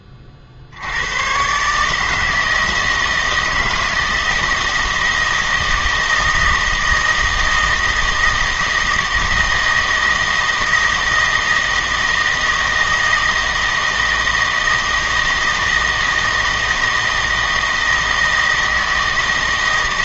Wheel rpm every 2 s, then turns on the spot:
60, 160, 160, 160, 160, 160, 160, 160, 160, 160.
none